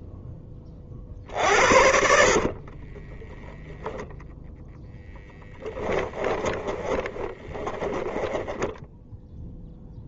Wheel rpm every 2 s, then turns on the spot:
10, 40, 0, 20, 10.
2-4 6-10